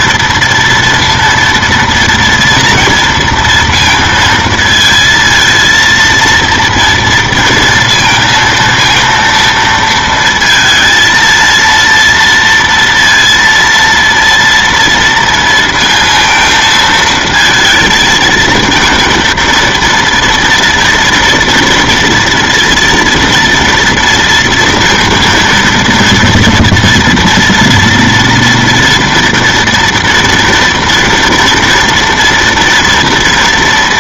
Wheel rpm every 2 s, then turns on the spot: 230, 230, 230, 230, 230, 230, 230, 230, 230, 230, 230, 230, 230, 230, 230, 230, 230.
none